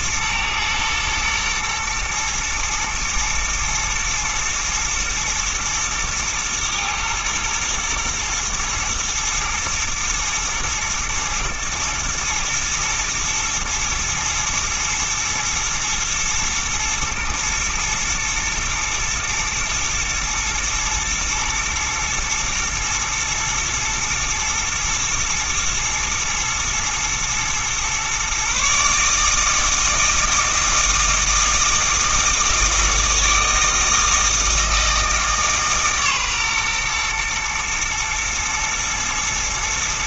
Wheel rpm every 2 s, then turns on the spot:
120, 110, 110, 110, 120, 110, 110, 110, 110, 120, 120, 120, 110, 120, 140, 160, 160, 160, 120, 110.
none